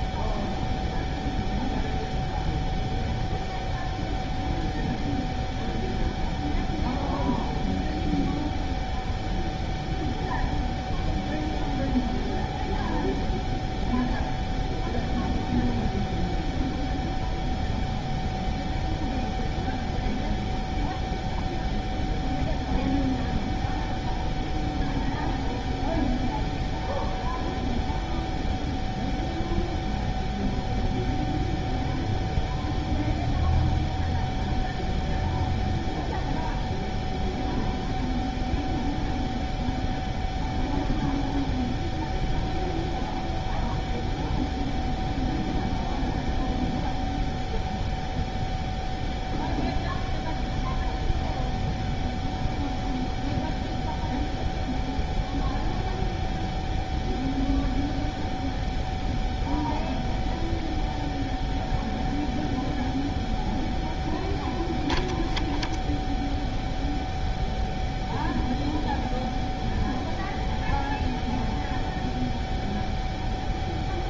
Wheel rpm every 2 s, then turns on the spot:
0, 0, 0, 0, 0, 0, 0, 0, 0, 0, 0, 0, 0, 0, 0, 0, 0, 0, 0, 0, 0, 0, 0, 0, 0, 0, 0, 0, 0, 0, 0, 0, 0, 0, 0, 0, 0.
none